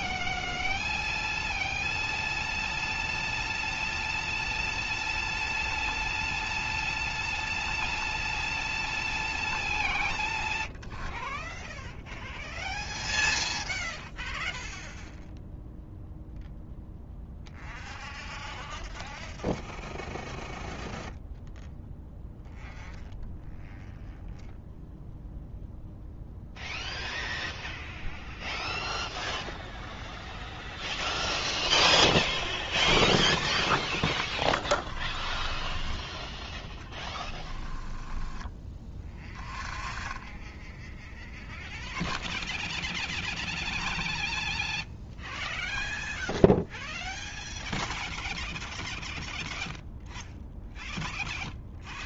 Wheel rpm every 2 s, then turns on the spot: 0, 0, 0, 0, 0, 10, 0, 0, 0, 0, 0, 0, 0, 0, 0, 0, 0, 10, 10, 20, 10, 0, 0, 0, 0, 0.
34-38